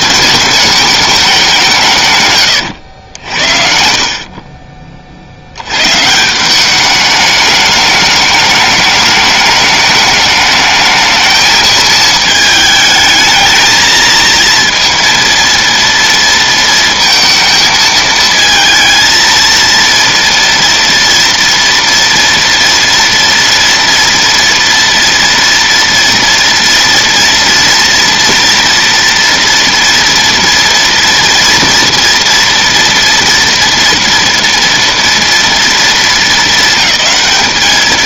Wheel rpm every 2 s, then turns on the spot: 210, 90, 40, 200, 210, 210, 220, 230, 230, 220, 230, 230, 230, 230, 230, 230, 230, 230, 200.
none